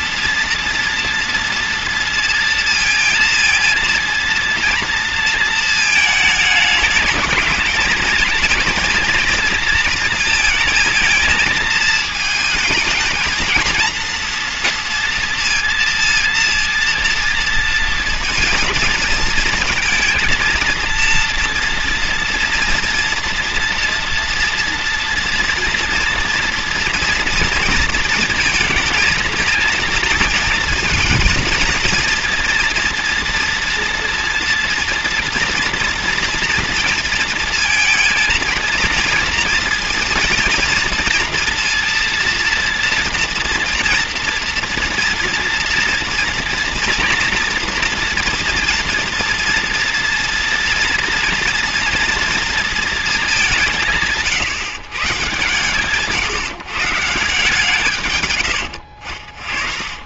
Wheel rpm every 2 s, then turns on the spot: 230, 230, 230, 210, 230, 230, 220, 230, 230, 220, 230, 240, 230, 230, 220, 220, 230, 230, 230, 230, 230, 240, 230, 230, 230, 230, 230, 140, 150, 80.
58-60